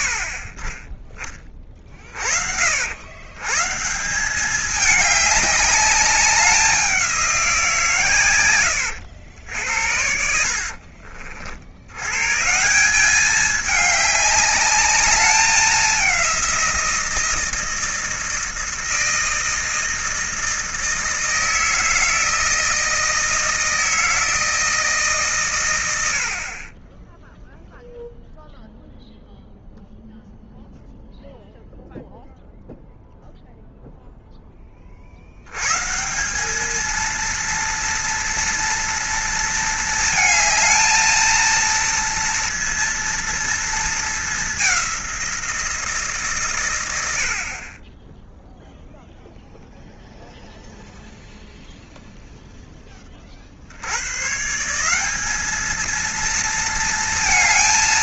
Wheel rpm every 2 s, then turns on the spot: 50, 80, 210, 190, 90, 50, 170, 210, 170, 160, 160, 160, 160, 30, 0, 0, 0, 30, 220, 230, 220, 230, 190, 110, 0, 0, 10, 170, 230.
8-12